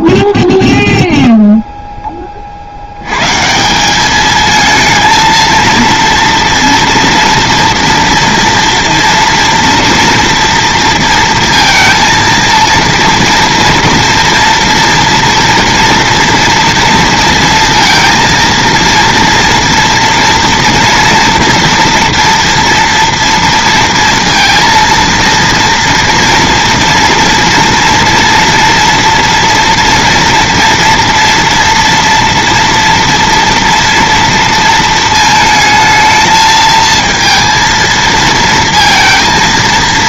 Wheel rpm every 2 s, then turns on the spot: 0, 40, 220, 230, 230, 230, 230, 230, 240, 230, 230, 240, 230, 230, 230, 240, 230, 230, 220, 230.
none